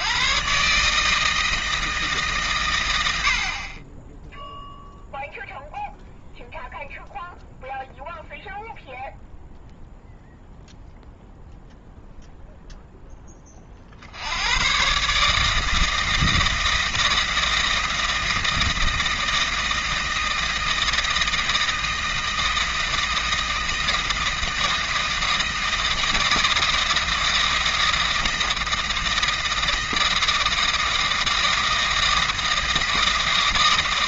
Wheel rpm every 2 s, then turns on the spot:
140, 100, 0, 0, 0, 0, 0, 120, 160, 160, 160, 160, 160, 160, 160, 160, 160.
none